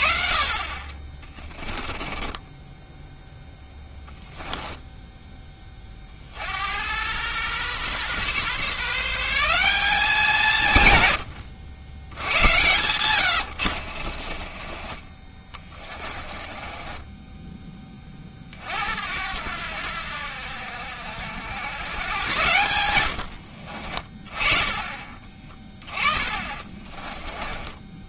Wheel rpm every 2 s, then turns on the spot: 30, 10, 10, 90, 150, 160, 100, 30, 20, 70, 70, 100, 30, 30.
4-6 12-18 26-28